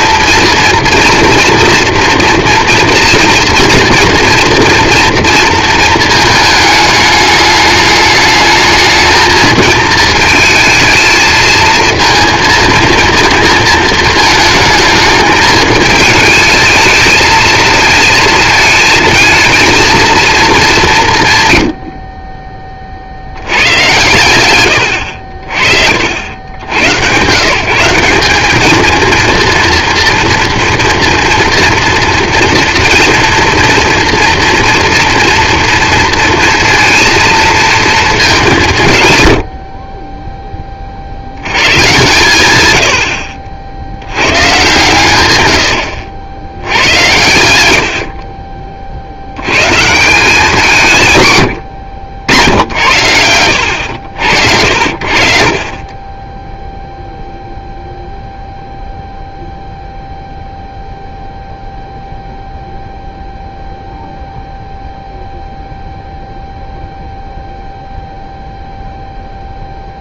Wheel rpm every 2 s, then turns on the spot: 230, 230, 230, 220, 220, 220, 230, 220, 220, 220, 210, 30, 110, 80, 210, 230, 240, 230, 230, 190, 10, 90, 140, 90, 20, 180, 90, 70, 0, 0, 0, 0, 0, 0, 0.
none